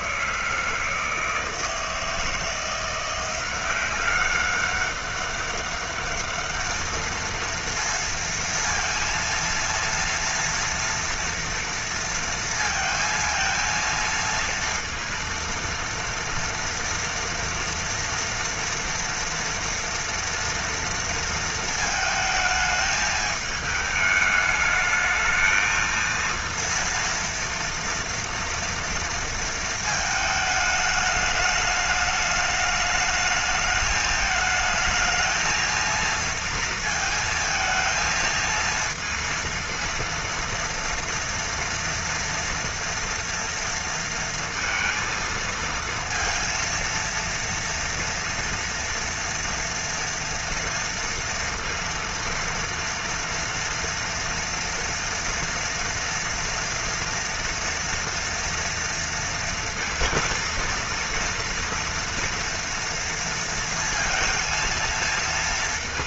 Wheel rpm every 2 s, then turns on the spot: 160, 170, 200, 220, 230, 230, 230, 230, 230, 240, 230, 220, 210, 230, 230, 210, 210, 220, 230, 230, 240, 240, 230, 230, 230, 230, 230, 230, 240, 230, 230, 240, 230.
none